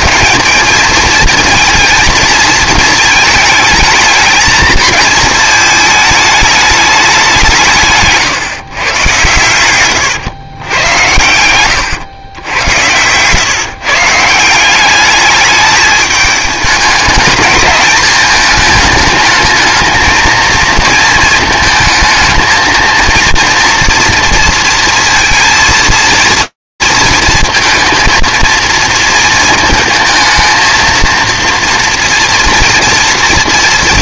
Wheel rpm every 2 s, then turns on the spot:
220, 220, 220, 210, 130, 110, 110, 190, 210, 210, 230, 230, 230, 230, 230, 230, 230.
none